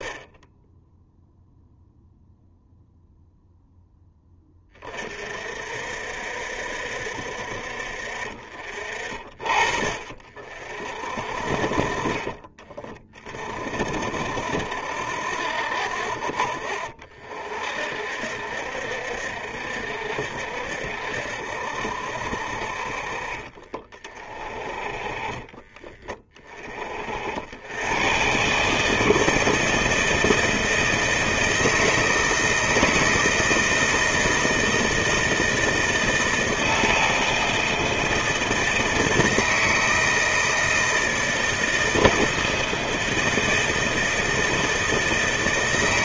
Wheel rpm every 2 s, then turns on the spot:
10, 0, 30, 60, 40, 50, 30, 60, 50, 60, 60, 40, 30, 40, 150, 160, 160, 160, 160, 160, 160, 160, 160.
none